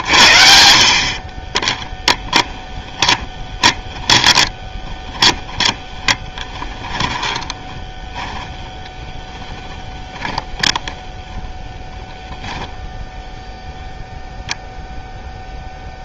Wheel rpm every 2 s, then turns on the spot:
60, 10, 20, 20, 10, 10, 0, 0.
2-8 10-12